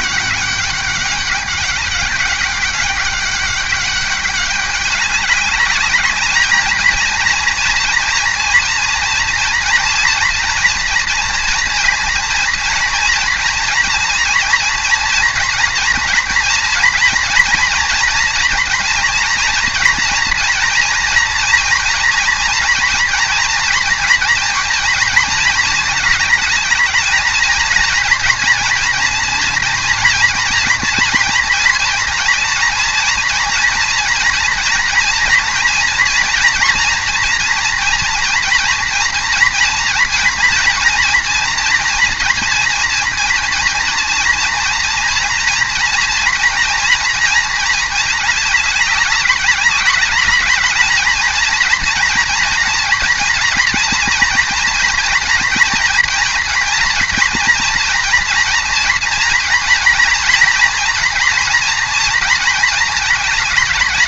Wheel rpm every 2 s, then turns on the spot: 200, 200, 200, 210, 230, 230, 230, 230, 230, 230, 230, 230, 230, 220, 230, 230, 230, 230, 240, 230, 230, 240, 230, 230, 210, 200, 240, 230, 230, 240, 240, 230.
none